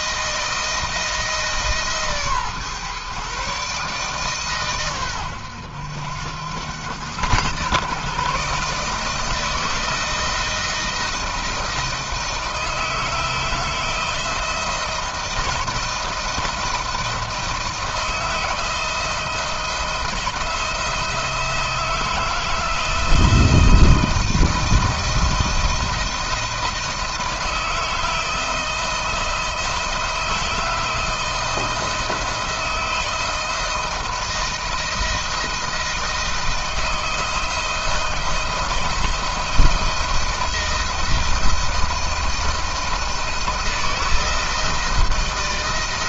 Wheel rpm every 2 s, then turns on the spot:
160, 140, 130, 100, 150, 160, 170, 160, 170, 160, 170, 160, 160, 170, 160, 170, 170, 170, 160, 170, 170, 170, 160.
none